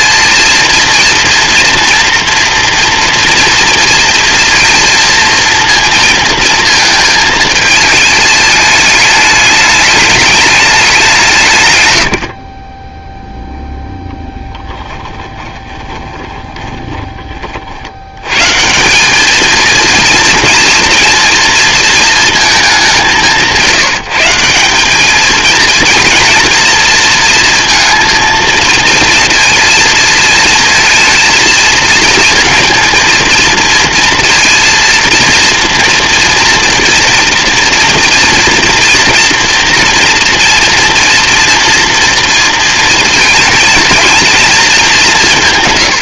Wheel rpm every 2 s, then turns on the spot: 230, 230, 230, 220, 210, 190, 10, 10, 20, 200, 230, 190, 210, 230, 230, 220, 230, 230, 240, 230, 230, 230, 190.
12-16